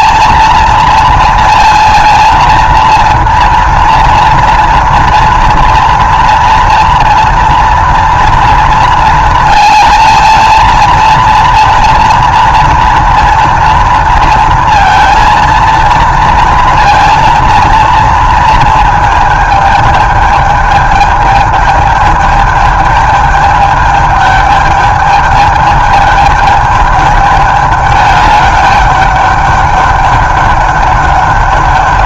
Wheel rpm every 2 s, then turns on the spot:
230, 230, 230, 230, 230, 230, 230, 230, 230, 220, 210, 210, 210, 210, 200, 200.
none